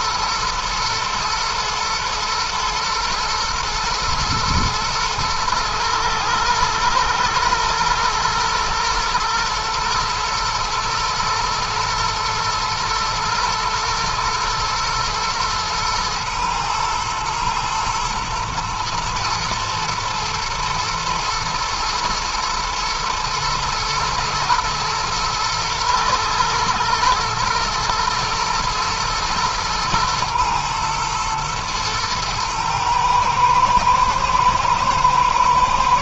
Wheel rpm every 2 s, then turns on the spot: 110, 120, 120, 110, 110, 110, 120, 120, 120, 110, 120, 110, 120, 110, 120, 120, 110, 110.
none